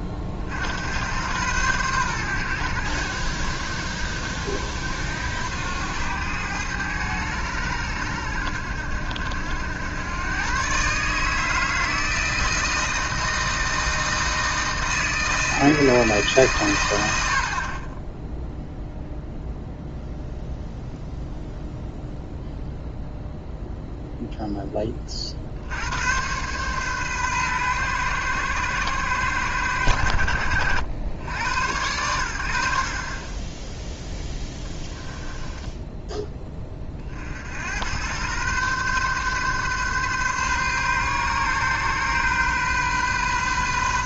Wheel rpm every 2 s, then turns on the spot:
80, 90, 70, 100, 70, 130, 160, 160, 110, 0, 0, 0, 20, 130, 110, 80, 70, 10, 30, 130, 130, 130.
34-36